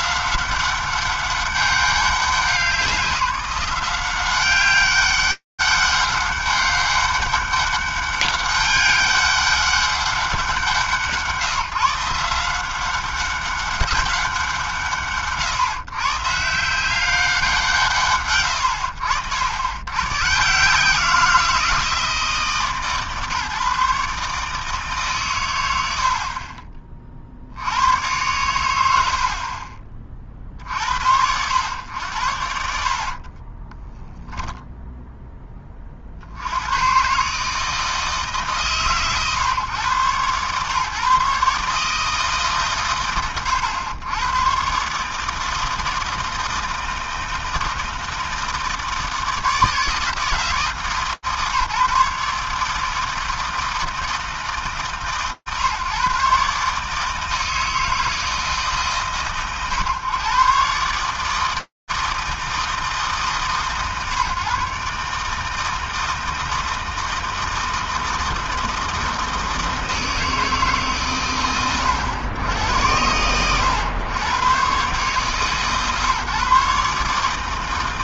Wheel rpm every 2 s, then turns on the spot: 160, 200, 180, 200, 200, 200, 150, 190, 130, 190, 90, 170, 140, 120, 80, 30, 100, 30, 20, 150, 130, 150, 90, 160, 160, 160, 140, 160, 140, 160, 130, 160, 140, 160, 160, 160, 90, 110, 150.
30-32 34-36